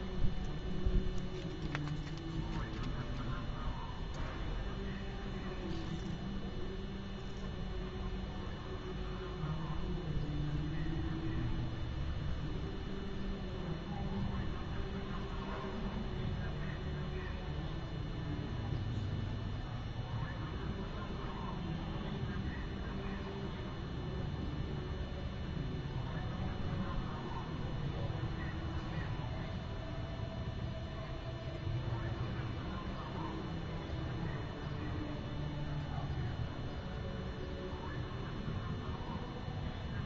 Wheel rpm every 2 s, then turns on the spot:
0, 0, 0, 0, 0, 0, 0, 0, 0, 0, 0, 0, 0, 0, 0, 0, 0, 0, 0, 0.
none